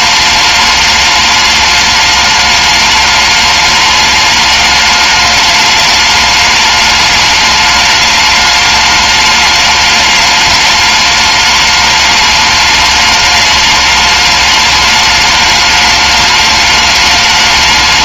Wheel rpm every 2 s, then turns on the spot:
210, 210, 210, 210, 210, 210, 210, 210, 210.
none